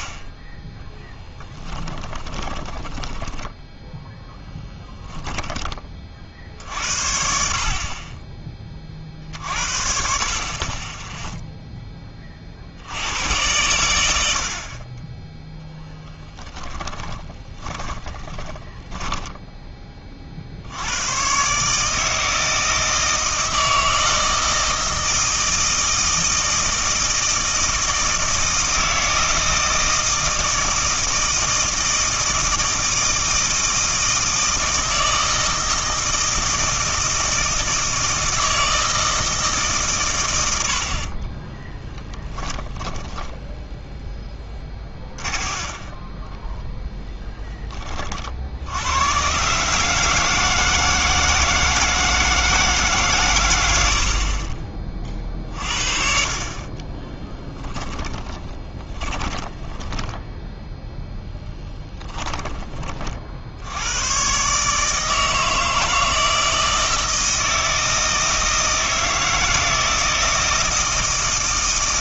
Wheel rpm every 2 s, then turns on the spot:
10, 20, 10, 60, 30, 30, 60, 50, 10, 20, 70, 160, 160, 160, 160, 160, 160, 160, 160, 160, 90, 10, 20, 10, 70, 160, 160, 40, 30, 20, 0, 20, 140, 160, 160, 160.
2-6 14-20 42-48 56-60